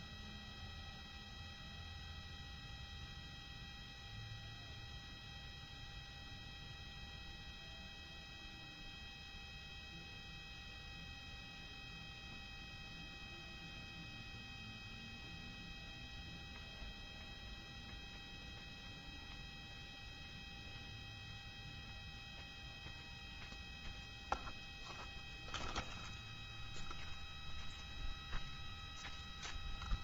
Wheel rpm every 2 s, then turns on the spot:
0, 0, 0, 0, 0, 0, 0, 0, 0, 0, 0, 0, 0, 0, 0.
none